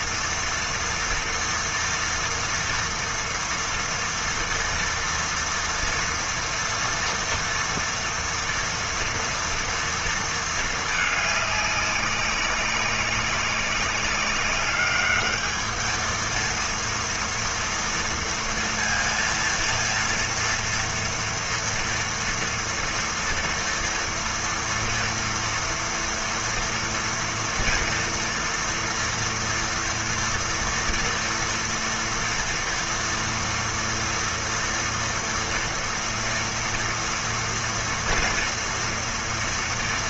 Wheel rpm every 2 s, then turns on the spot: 230, 230, 230, 230, 230, 230, 200, 200, 230, 230, 230, 230, 230, 230, 240, 230, 230, 230, 230, 230.
none